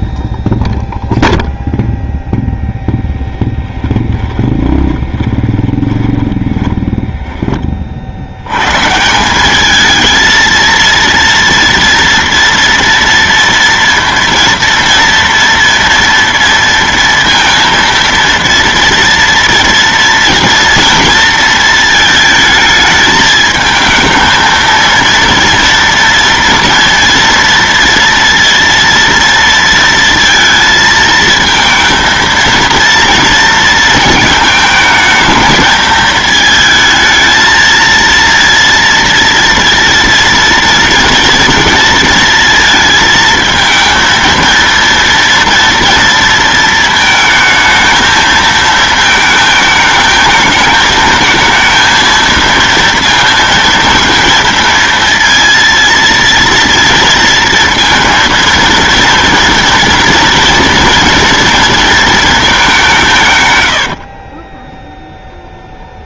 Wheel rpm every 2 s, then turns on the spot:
0, 10, 20, 20, 130, 230, 230, 230, 230, 230, 240, 220, 230, 230, 230, 230, 230, 220, 220, 230, 230, 220, 230, 230, 220, 220, 230, 230, 230, 230, 230, 190, 0.
2-8